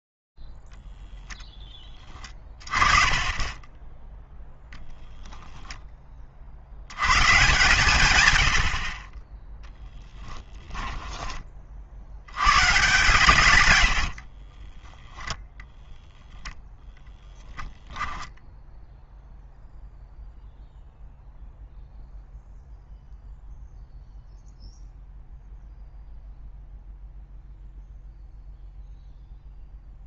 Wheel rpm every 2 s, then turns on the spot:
0, 30, 0, 70, 90, 10, 130, 10, 20, 0, 0, 0, 0, 0, 10.
2-4 10-12 14-18